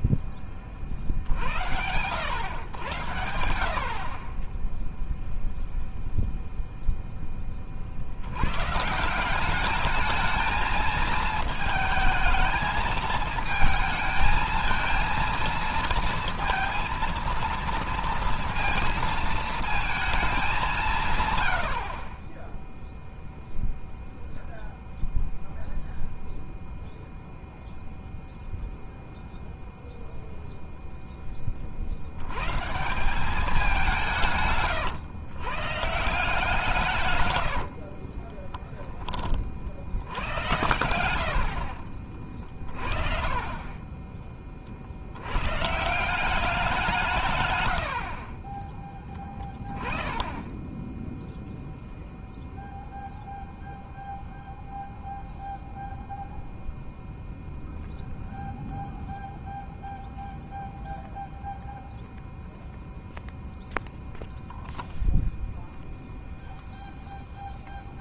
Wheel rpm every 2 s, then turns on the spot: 40, 100, 10, 0, 120, 220, 220, 220, 230, 230, 200, 20, 0, 0, 0, 0, 140, 140, 160, 20, 90, 40, 50, 180, 20, 10, 0, 0, 0, 0, 0, 0, 0, 0.
48-50